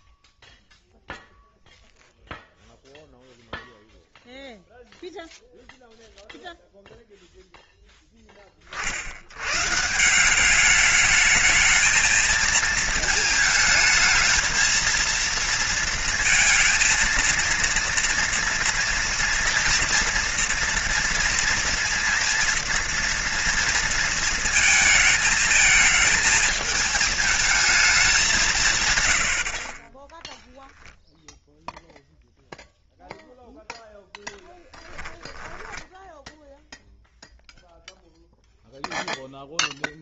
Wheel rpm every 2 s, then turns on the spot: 0, 0, 0, 0, 50, 210, 220, 230, 230, 230, 230, 240, 220, 220, 120, 0, 0, 10, 0, 0.
none